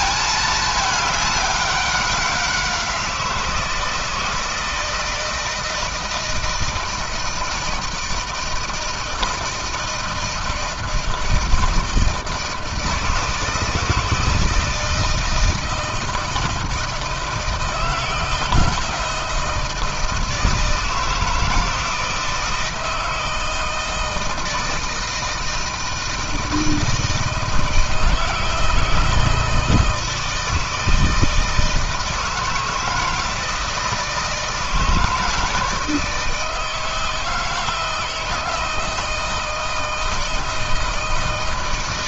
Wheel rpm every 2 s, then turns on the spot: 210, 180, 160, 160, 160, 170, 160, 160, 160, 170, 160, 160, 160, 160, 160, 160, 160, 160, 160, 160, 160.
none